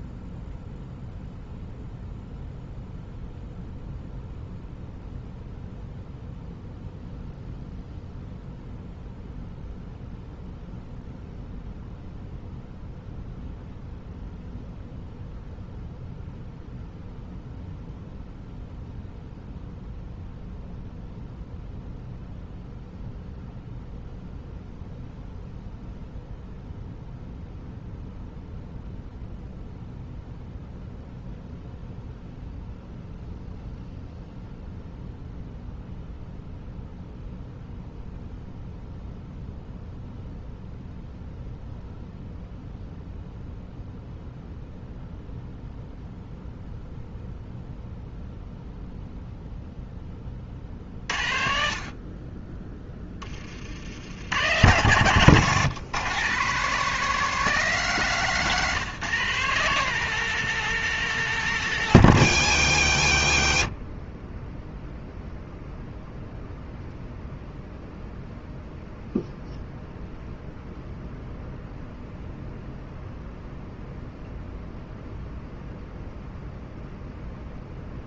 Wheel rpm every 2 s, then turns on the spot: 0, 0, 0, 0, 0, 0, 0, 0, 0, 0, 0, 0, 0, 0, 0, 0, 0, 0, 0, 0, 0, 0, 0, 0, 0, 60, 20, 110, 170, 160, 180, 70, 0, 0, 0, 0, 0, 0, 0.
none